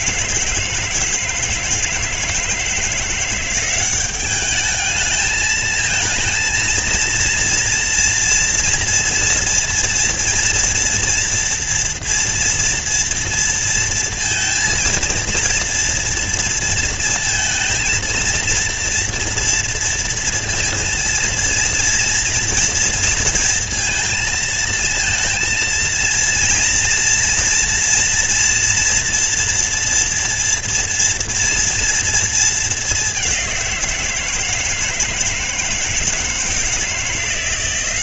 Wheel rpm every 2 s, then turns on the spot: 160, 160, 200, 220, 230, 230, 230, 230, 230, 230, 230, 230, 230, 230, 230, 230, 230, 170, 160.
none